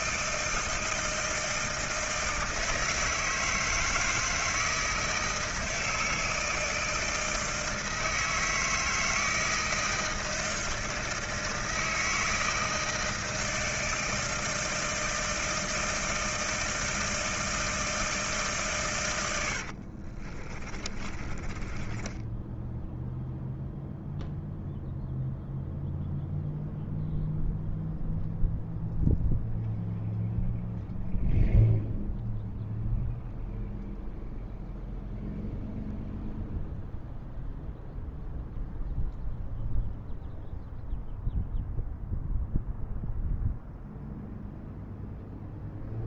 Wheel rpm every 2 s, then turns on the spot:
160, 160, 160, 160, 160, 160, 160, 160, 160, 130, 20, 10, 0, 0, 0, 0, 0, 0, 0, 0, 0, 0, 0.
20-24